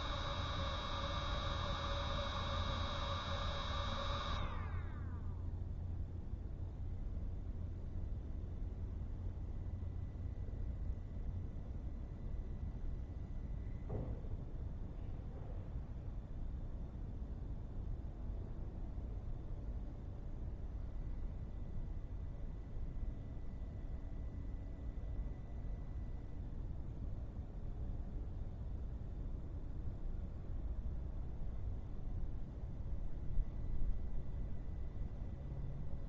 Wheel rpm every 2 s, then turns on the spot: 0, 0, 0, 0, 0, 0, 0, 0, 0, 0, 0, 0, 0, 0, 0, 0, 0, 0.
none